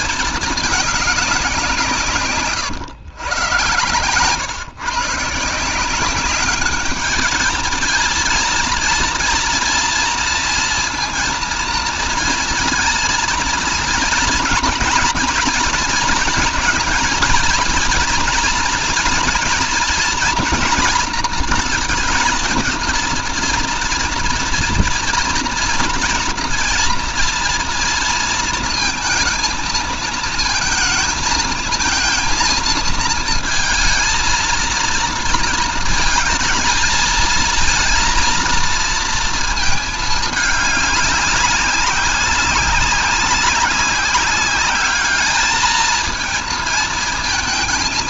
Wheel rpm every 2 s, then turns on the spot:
200, 130, 160, 220, 230, 230, 230, 230, 230, 230, 230, 230, 230, 230, 230, 230, 220, 230, 220, 230, 200, 190, 210, 230.
none